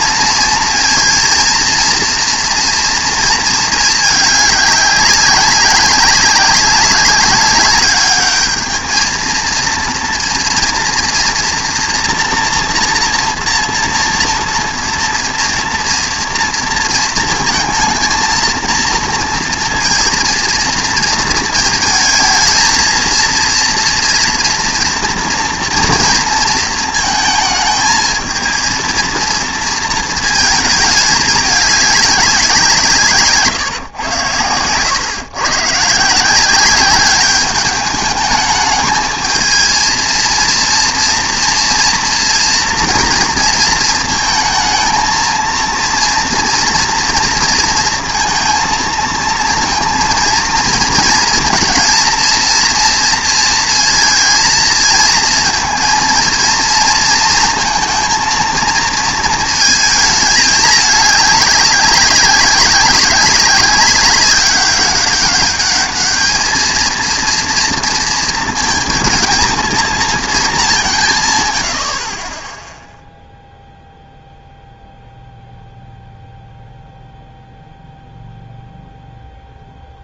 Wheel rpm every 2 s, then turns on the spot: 230, 230, 200, 190, 220, 230, 230, 230, 230, 230, 230, 220, 230, 230, 230, 220, 170, 110, 180, 210, 230, 230, 220, 240, 230, 230, 230, 220, 230, 230, 210, 190, 200, 220, 220, 200, 10, 0, 0, 0.
none